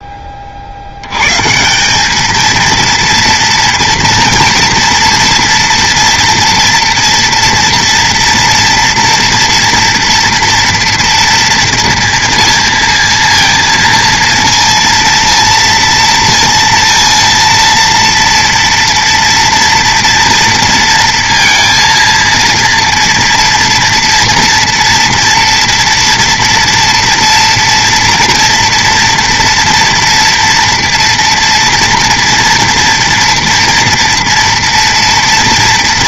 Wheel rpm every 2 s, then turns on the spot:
60, 230, 230, 230, 230, 230, 230, 230, 230, 230, 230, 230, 230, 230, 230, 230, 230, 240.
none